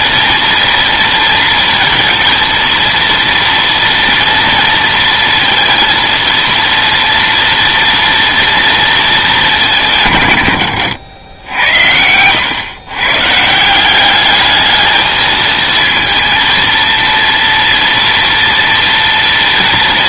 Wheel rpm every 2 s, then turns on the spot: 230, 230, 230, 230, 230, 100, 120, 210, 230, 230.
none